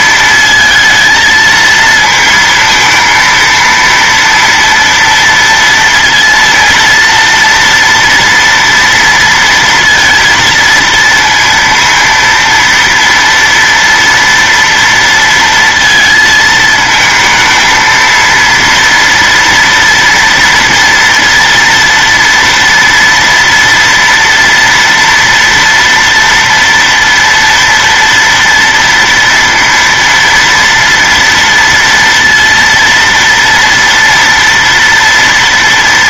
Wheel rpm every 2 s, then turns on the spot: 230, 230, 230, 230, 230, 230, 230, 230, 220, 230, 230, 230, 230, 230, 230, 230, 230, 230.
none